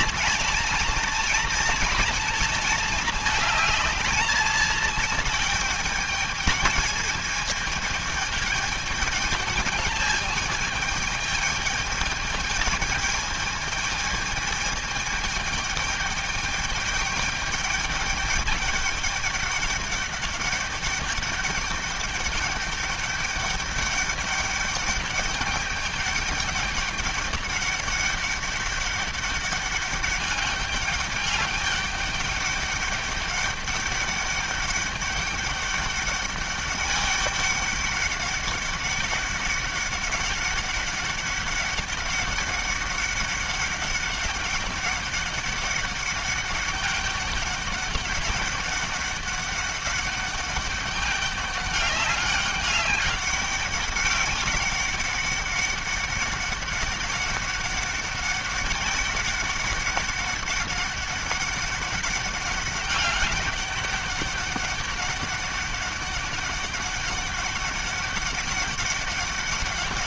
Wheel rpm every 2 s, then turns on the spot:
230, 220, 220, 210, 220, 210, 210, 220, 210, 210, 200, 210, 200, 200, 200, 200, 200, 200, 200, 200, 200, 200, 200, 200, 200, 200, 200, 200, 200, 200, 200, 200, 200, 200, 200.
none